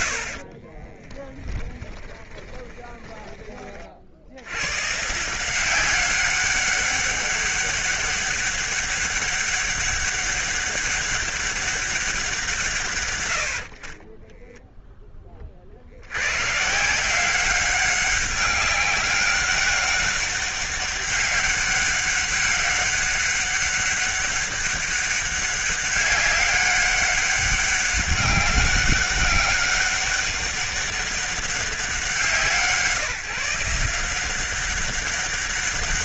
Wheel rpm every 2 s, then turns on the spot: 50, 20, 110, 200, 200, 200, 150, 0, 120, 200, 200, 190, 200, 200, 190, 190, 170, 190.
2-4